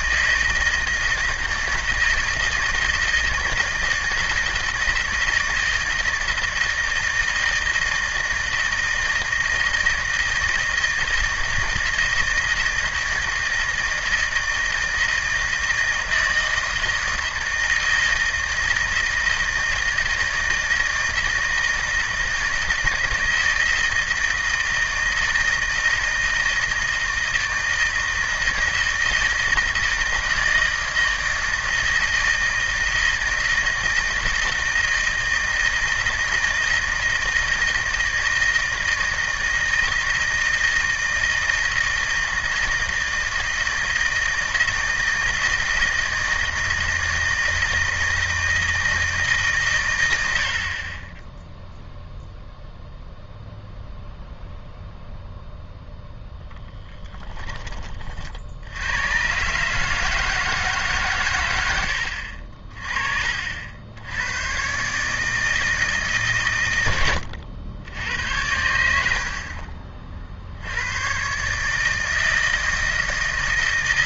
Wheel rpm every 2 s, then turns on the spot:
160, 160, 160, 160, 160, 160, 160, 160, 160, 160, 160, 160, 160, 160, 160, 160, 160, 160, 160, 160, 160, 160, 160, 160, 160, 80, 0, 0, 10, 70, 150, 50, 120, 110, 80, 70, 160.
56-58